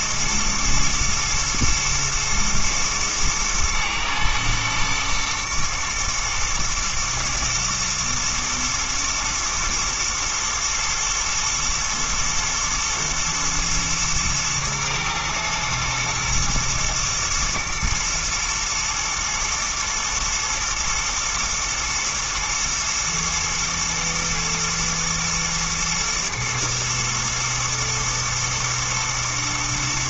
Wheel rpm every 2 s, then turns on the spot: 120, 110, 110, 110, 110, 110, 120, 110, 120, 110, 110, 110, 120, 120, 110.
none